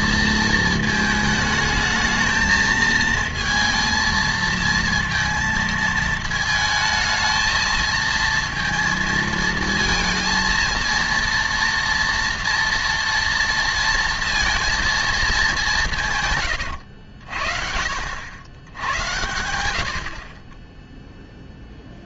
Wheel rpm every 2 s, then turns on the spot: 230, 220, 230, 220, 230, 230, 240, 230, 110, 90, 20.
16-18